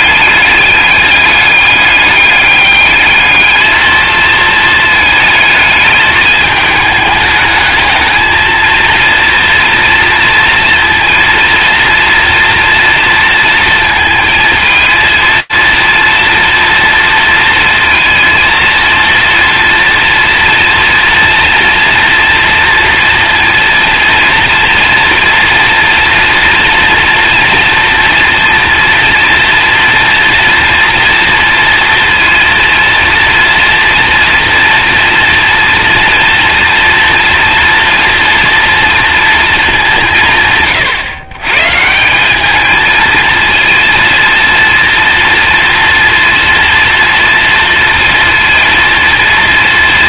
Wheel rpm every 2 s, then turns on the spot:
200, 200, 230, 220, 220, 230, 230, 230, 230, 230, 230, 230, 230, 230, 240, 230, 230, 240, 240, 240, 160, 190, 230, 240, 230.
none